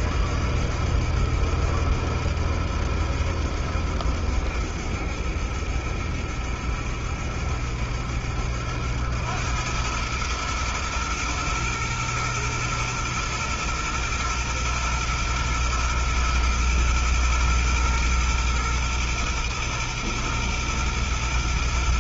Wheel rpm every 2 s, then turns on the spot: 70, 70, 70, 70, 80, 110, 120, 120, 120, 120, 120.
none